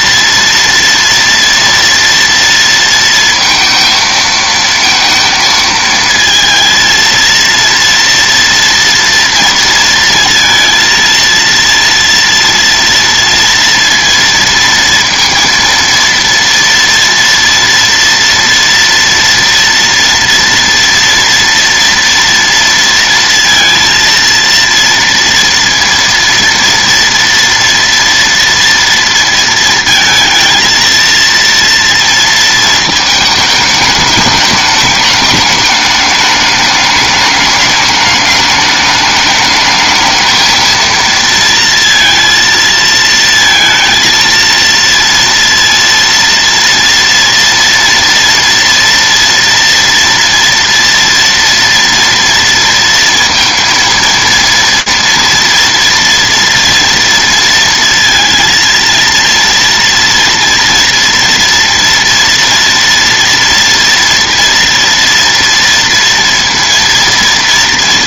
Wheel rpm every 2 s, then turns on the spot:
230, 230, 230, 230, 230, 230, 230, 230, 230, 230, 240, 230, 230, 230, 230, 230, 220, 210, 210, 210, 220, 230, 230, 230, 230, 230, 230, 230, 230, 230, 230, 230, 230, 230.
none